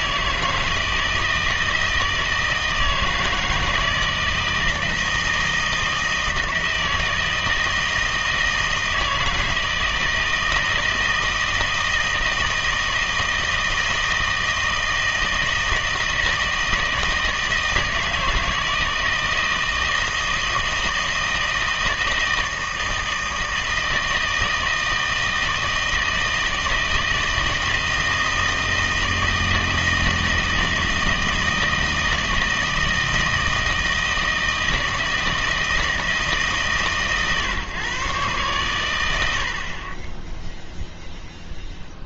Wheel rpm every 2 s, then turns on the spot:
160, 160, 160, 160, 160, 160, 160, 160, 160, 160, 160, 160, 160, 160, 160, 160, 160, 160, 140, 110, 0.
none